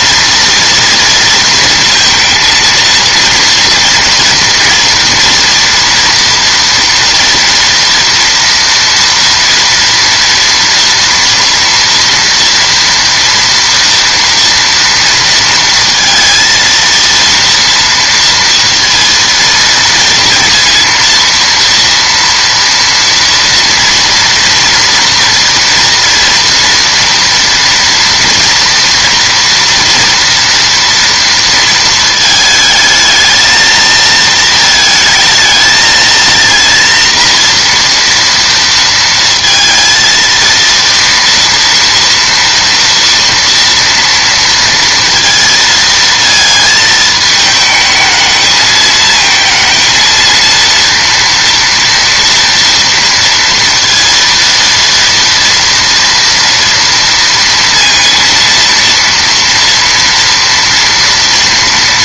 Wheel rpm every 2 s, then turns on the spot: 230, 230, 230, 230, 230, 230, 230, 230, 230, 230, 230, 230, 230, 240, 240, 230, 220, 220, 230, 230, 230, 230, 230, 220, 220, 230, 230, 230, 230, 230, 230.
none